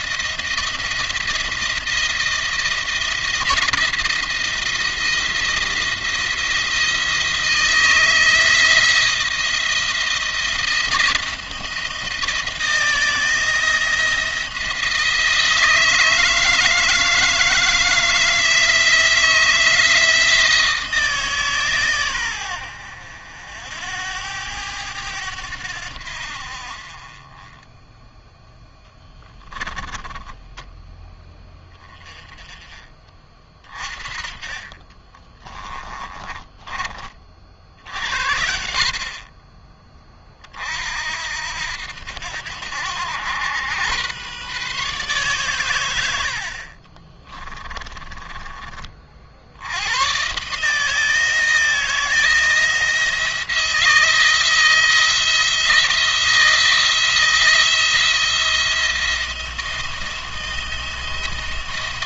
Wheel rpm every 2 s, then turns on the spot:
170, 170, 170, 170, 160, 170, 170, 170, 160, 170, 160, 100, 90, 50, 10, 10, 20, 40, 30, 60, 40, 90, 130, 50, 30, 140, 170, 160, 160, 170, 170.
28-32 34-36 46-48